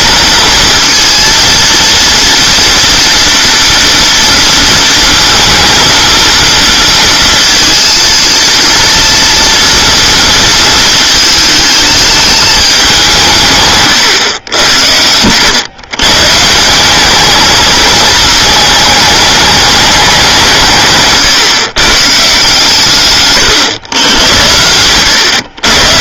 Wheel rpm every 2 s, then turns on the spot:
230, 240, 230, 230, 230, 230, 200, 90, 190, 220, 150, 150, 90.
none